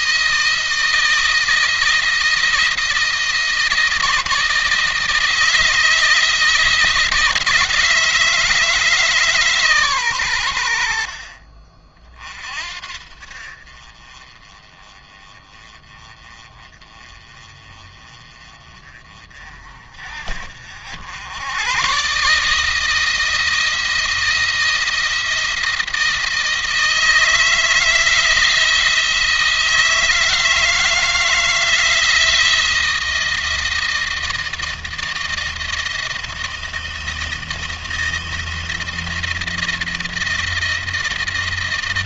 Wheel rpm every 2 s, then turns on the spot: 160, 170, 160, 160, 150, 80, 50, 30, 30, 30, 70, 150, 160, 160, 160, 160, 170, 160, 160, 170, 160.
none